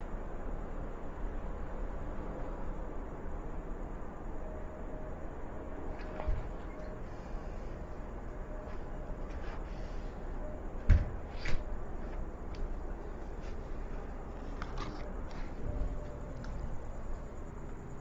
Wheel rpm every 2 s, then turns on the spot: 0, 0, 0, 0, 0, 0, 0, 0, 0.
none